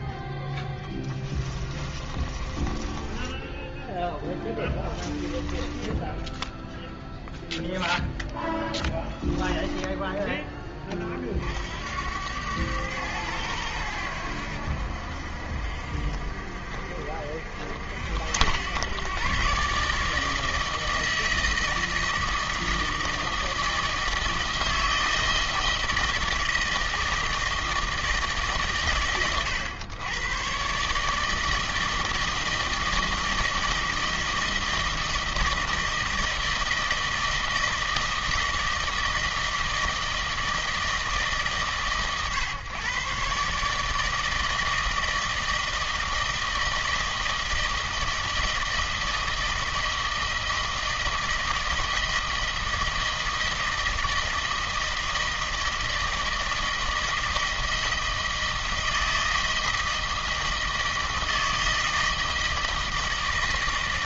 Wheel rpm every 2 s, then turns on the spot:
10, 20, 10, 0, 10, 30, 100, 70, 60, 110, 160, 160, 160, 160, 130, 140, 160, 160, 160, 160, 160, 130, 160, 160, 160, 160, 160, 160, 160, 160, 160, 160.
0-6 8-10